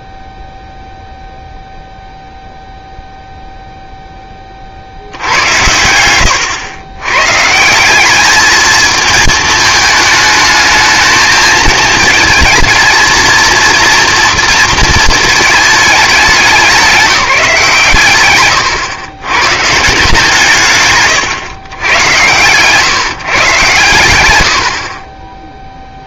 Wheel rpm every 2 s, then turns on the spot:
0, 0, 60, 100, 220, 220, 220, 230, 190, 120, 140, 130, 70.
none